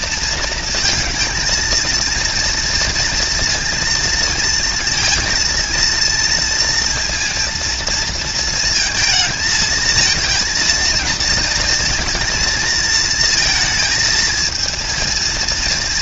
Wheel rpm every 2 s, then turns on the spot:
230, 230, 230, 230, 220, 220, 220, 230.
none